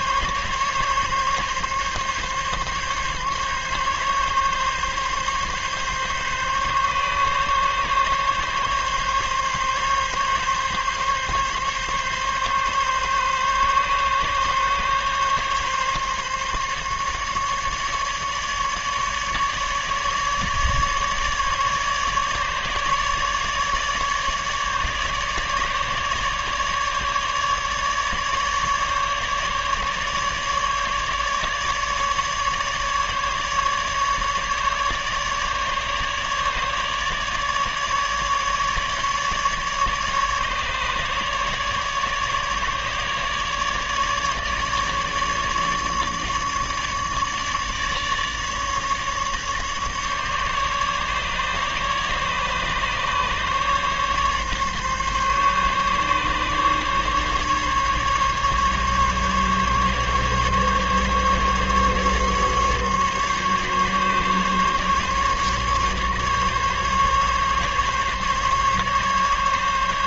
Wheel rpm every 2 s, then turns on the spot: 140, 140, 140, 140, 140, 140, 140, 140, 140, 150, 150, 150, 150, 150, 150, 150, 150, 150, 150, 150, 150, 150, 150, 150, 150, 150, 140, 140, 140, 140, 140, 140, 140, 140, 140.
none